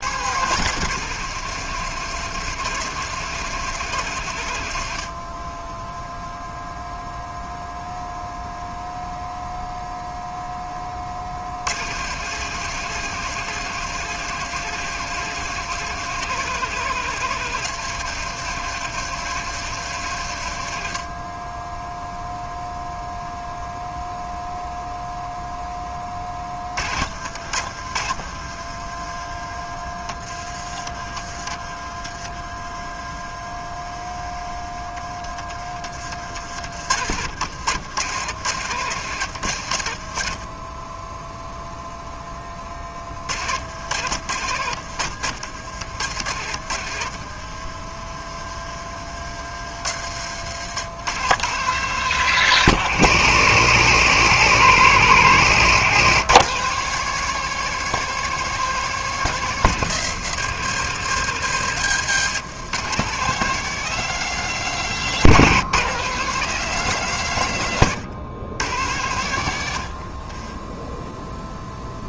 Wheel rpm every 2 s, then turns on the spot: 150, 140, 50, 0, 0, 40, 140, 140, 140, 140, 50, 0, 0, 60, 40, 50, 30, 20, 70, 110, 10, 30, 80, 60, 40, 110, 140, 130, 160, 160, 130, 150, 150, 140, 90, 0.
26-30 32-34 46-48 64-66